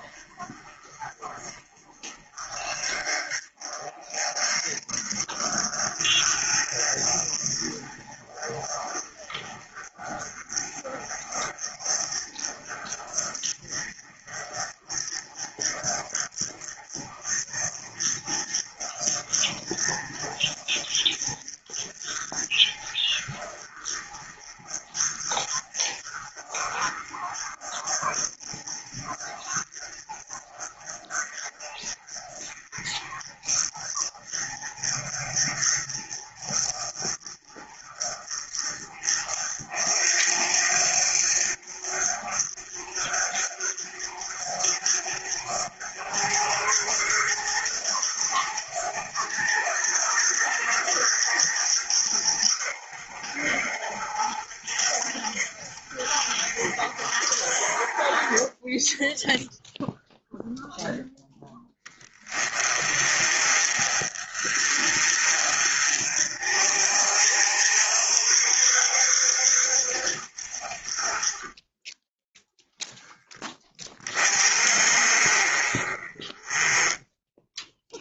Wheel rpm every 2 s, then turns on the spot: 40, 40, 40, 40, 40, 40, 40, 40, 40, 40, 40, 40, 40, 40, 40, 40, 40, 40, 40, 40, 50, 50, 50, 50, 60, 60, 60, 60, 60, 10, 0, 30, 40, 50, 60, 30, 10, 40, 10.
none